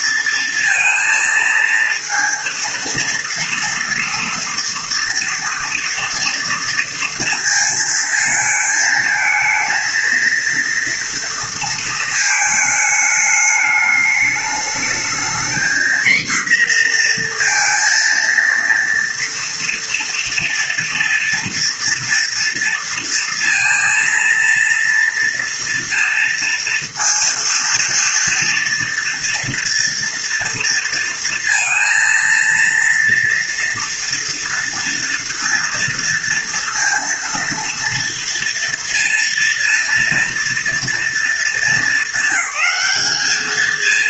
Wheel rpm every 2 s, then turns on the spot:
230, 230, 230, 230, 220, 230, 220, 220, 240, 230, 240, 230, 230, 230, 230, 230, 230, 230, 230, 230, 230, 200.
none